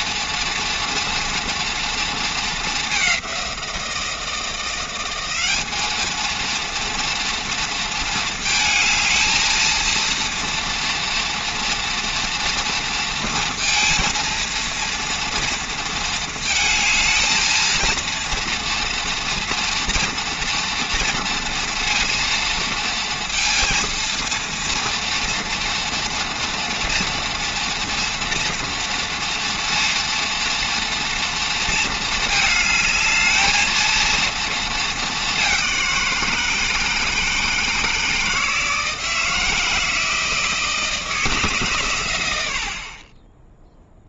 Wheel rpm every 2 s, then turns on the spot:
240, 200, 170, 230, 220, 230, 230, 230, 220, 230, 230, 230, 240, 230, 230, 230, 220, 220, 160, 160, 160, 40.
none